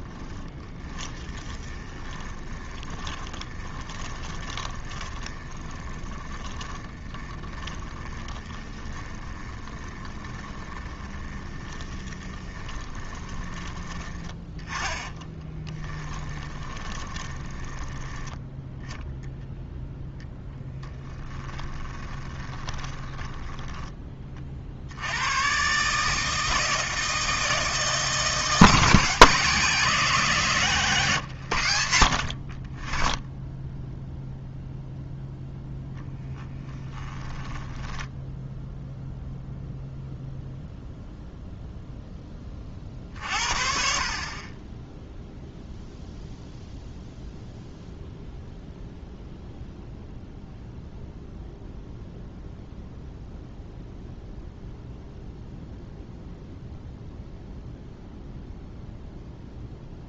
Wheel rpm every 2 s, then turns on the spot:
20, 20, 30, 30, 20, 20, 20, 10, 20, 0, 10, 20, 50, 160, 150, 130, 20, 0, 10, 0, 0, 40, 10, 0, 0, 0, 0, 0, 0, 0.
0-18 20-24 30-32 36-38